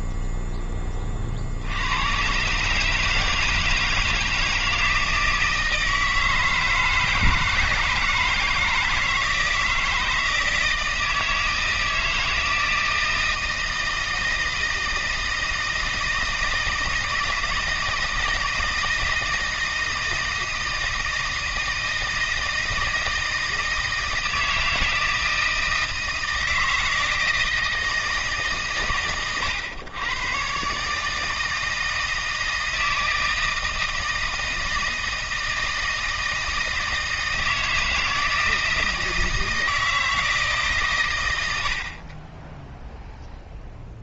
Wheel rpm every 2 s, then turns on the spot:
0, 130, 170, 160, 160, 160, 160, 160, 160, 160, 160, 160, 160, 160, 100, 140, 160, 160, 160, 160, 140, 0.
none